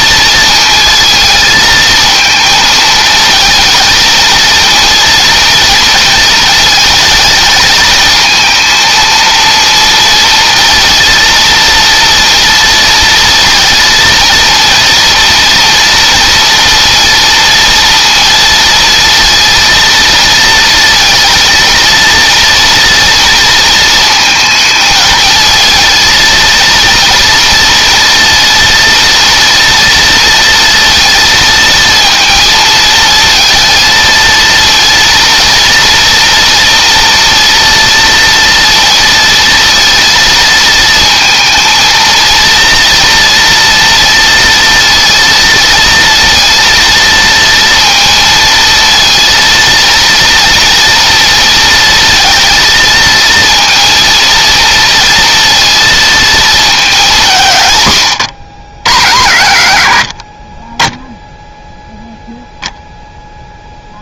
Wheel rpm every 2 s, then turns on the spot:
220, 220, 230, 220, 230, 230, 230, 230, 230, 230, 230, 230, 220, 230, 230, 230, 220, 230, 230, 230, 230, 230, 230, 230, 230, 230, 220, 230, 210, 80, 10, 20.
none